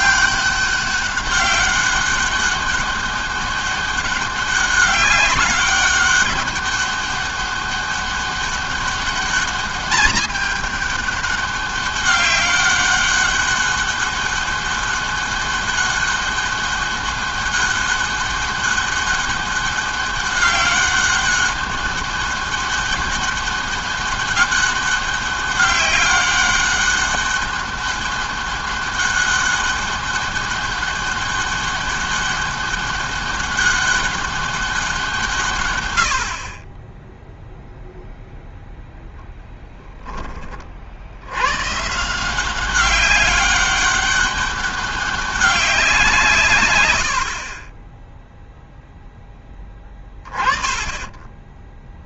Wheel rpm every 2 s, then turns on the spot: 200, 200, 200, 200, 200, 200, 200, 200, 200, 200, 200, 200, 200, 200, 200, 200, 200, 180, 20, 0, 70, 190, 190, 90, 0, 20.
46-48